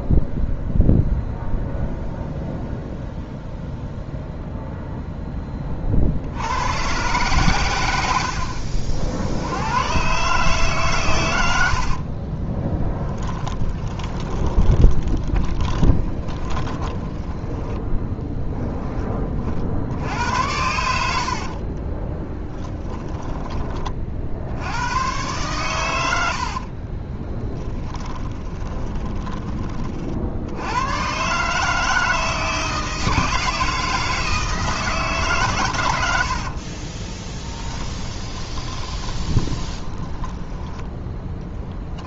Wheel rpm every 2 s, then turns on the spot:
0, 0, 0, 120, 60, 140, 10, 20, 20, 10, 70, 10, 100, 30, 20, 110, 160, 150, 30, 20, 10.
12-18 22-24 26-30 36-40